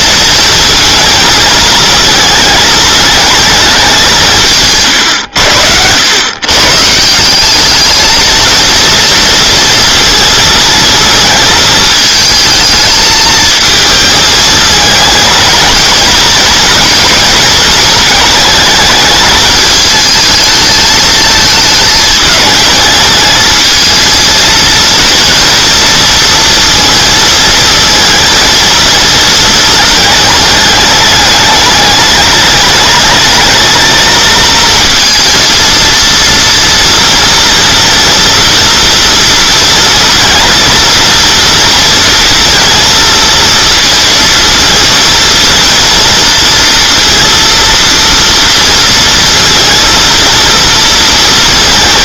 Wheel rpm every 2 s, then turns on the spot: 220, 220, 140, 140, 230, 230, 220, 220, 220, 220, 220, 220, 230, 230, 230, 220, 210, 220, 230, 230, 230, 230, 230, 230, 230, 230.
none